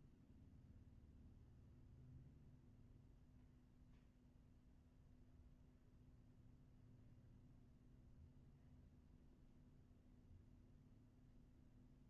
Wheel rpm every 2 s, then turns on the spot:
0, 0, 0, 0, 0, 0.
none